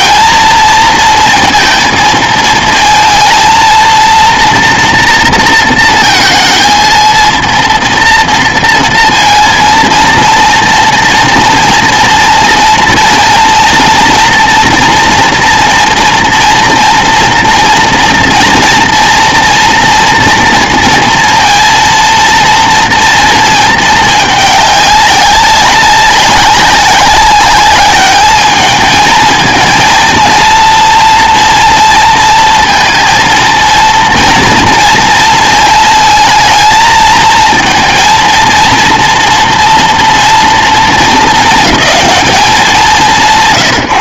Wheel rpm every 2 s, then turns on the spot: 230, 220, 230, 230, 230, 230, 230, 230, 230, 230, 230, 230, 200, 190, 220, 230, 230, 230, 230, 230, 220, 190.
none